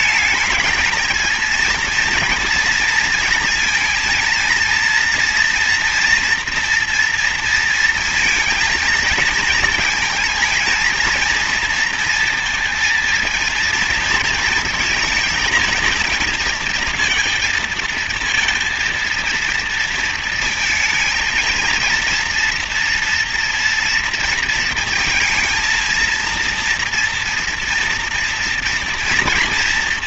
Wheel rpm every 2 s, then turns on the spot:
220, 230, 230, 240, 230, 230, 230, 230, 230, 230, 220, 230, 230, 230, 230.
none